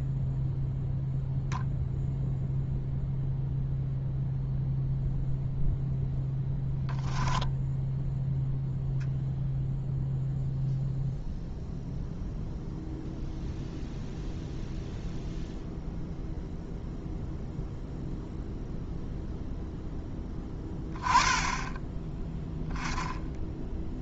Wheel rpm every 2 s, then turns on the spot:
0, 0, 0, 10, 0, 0, 0, 0, 0, 0, 10, 10.
none